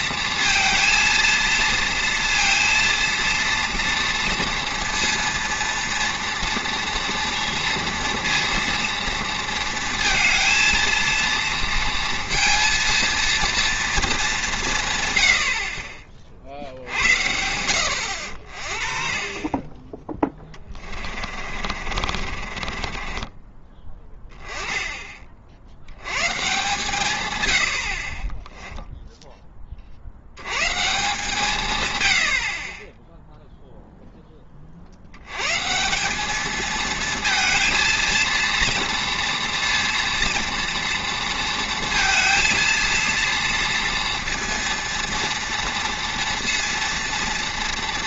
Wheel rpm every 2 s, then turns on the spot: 230, 230, 230, 230, 230, 230, 230, 170, 60, 40, 20, 30, 10, 130, 10, 140, 40, 50, 220, 230, 230, 230, 230, 230.
20-24 28-30